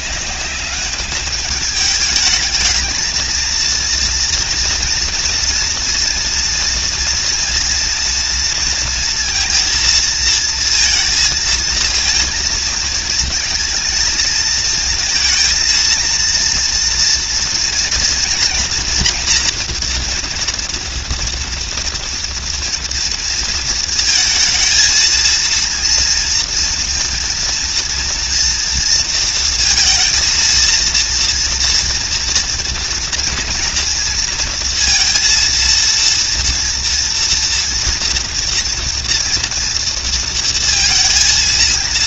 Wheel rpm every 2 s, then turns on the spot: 200, 220, 240, 240, 230, 220, 230, 230, 230, 230, 230, 230, 230, 230, 230, 230, 230, 230, 230, 230, 230.
none